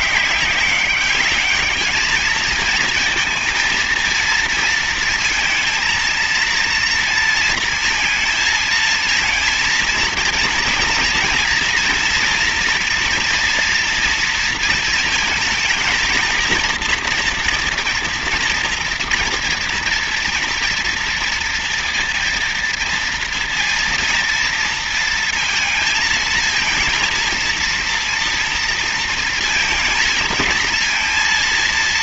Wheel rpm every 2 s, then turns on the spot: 190, 220, 230, 230, 220, 230, 230, 230, 230, 230, 230, 230, 230, 230, 230, 230.
none